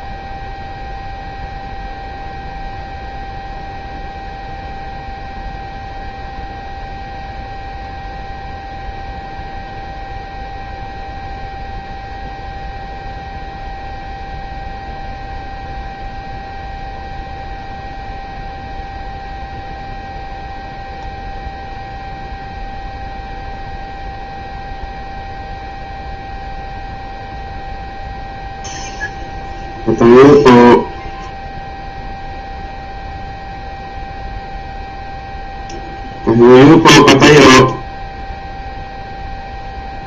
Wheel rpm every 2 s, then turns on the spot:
0, 0, 0, 0, 0, 0, 0, 0, 0, 0, 0, 0, 0, 0, 0, 0, 0, 0, 0, 0.
none